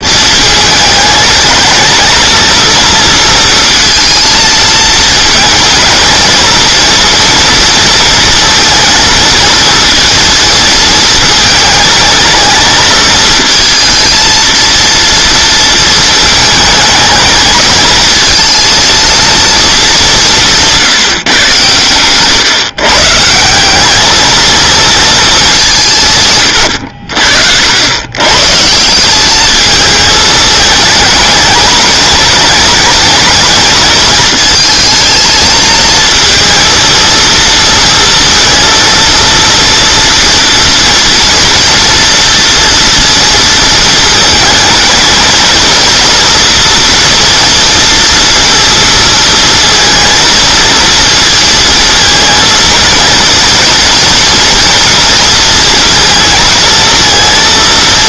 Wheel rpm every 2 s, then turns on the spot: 210, 230, 220, 230, 230, 230, 220, 230, 220, 230, 170, 140, 230, 110, 160, 220, 220, 220, 220, 230, 230, 230, 220, 230, 230, 230, 230, 230, 220.
none